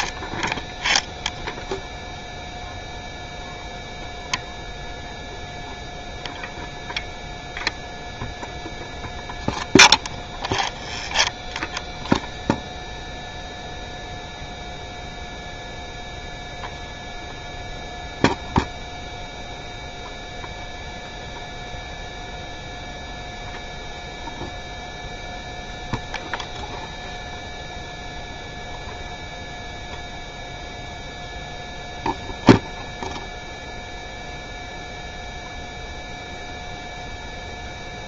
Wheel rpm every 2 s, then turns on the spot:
0, 0, 0, 0, 0, 0, 0, 0, 0, 0, 0, 0, 0, 0, 0, 0, 0, 0, 0.
none